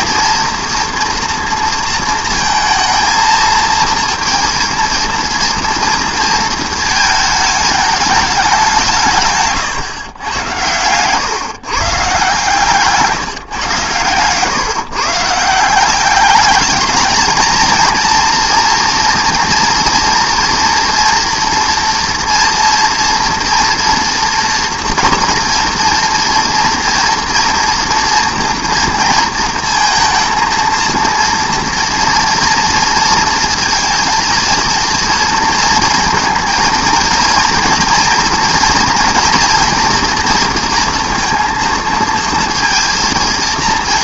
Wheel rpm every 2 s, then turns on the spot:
230, 230, 230, 230, 170, 120, 150, 130, 210, 240, 230, 240, 230, 230, 230, 230, 230, 230, 230, 230, 230, 230.
none